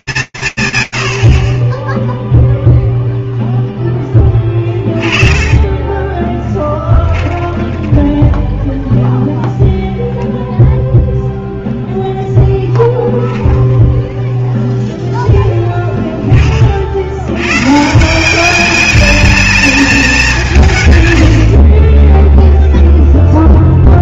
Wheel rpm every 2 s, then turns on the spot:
170, 0, 20, 10, 20, 0, 10, 0, 60, 210, 130, 0.
6-10